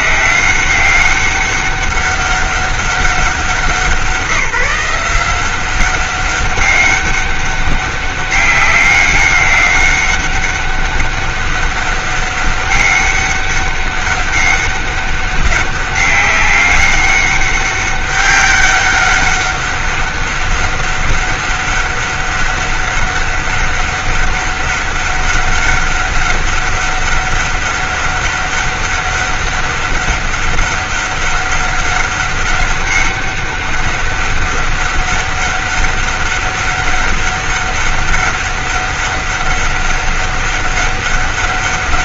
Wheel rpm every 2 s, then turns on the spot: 190, 200, 180, 200, 200, 200, 200, 200, 200, 200, 200, 200, 200, 200, 200, 200, 200, 200, 200, 200, 200.
none